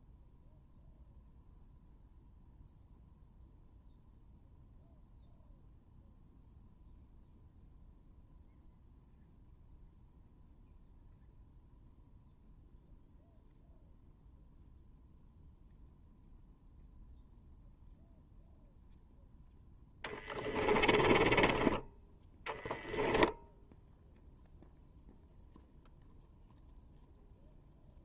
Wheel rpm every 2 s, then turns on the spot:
0, 0, 0, 0, 0, 0, 0, 0, 0, 0, 20, 0, 0, 0.
20-22